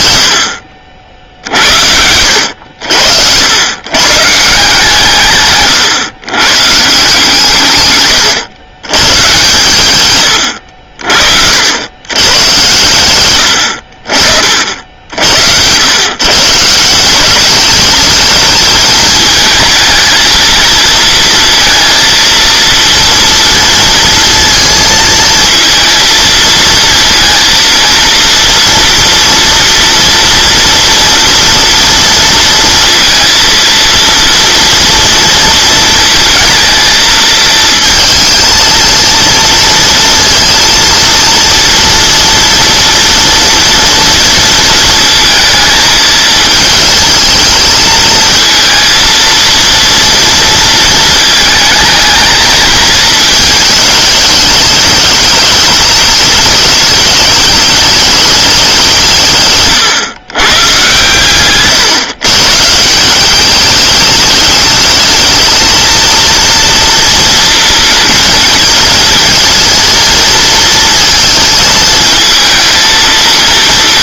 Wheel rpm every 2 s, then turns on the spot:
80, 80, 160, 140, 110, 80, 110, 60, 150, 220, 230, 230, 230, 220, 230, 230, 230, 230, 230, 230, 230, 230, 230, 220, 220, 230, 220, 210, 210, 200, 130, 140, 210, 230, 220, 230, 220.
10-12